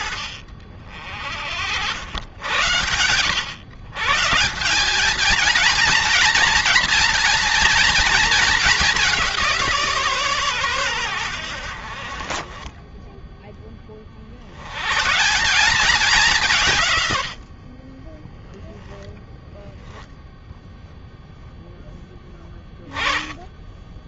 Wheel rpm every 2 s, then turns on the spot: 50, 100, 210, 230, 190, 90, 10, 150, 110, 10, 10, 20.
none